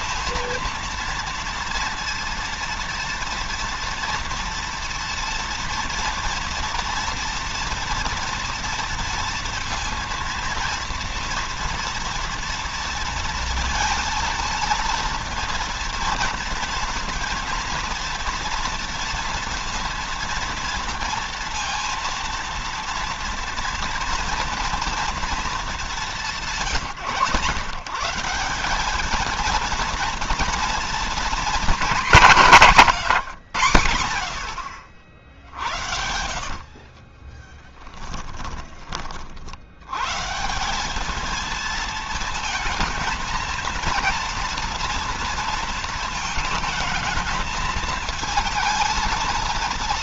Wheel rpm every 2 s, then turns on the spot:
230, 230, 230, 240, 240, 230, 230, 230, 230, 230, 230, 230, 230, 160, 200, 240, 200, 70, 60, 20, 170, 220, 230, 220, 230.
36-38